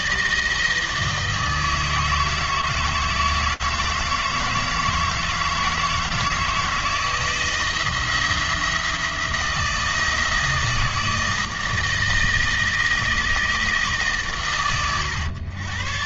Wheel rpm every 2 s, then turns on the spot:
160, 160, 160, 160, 170, 160, 160, 110.
none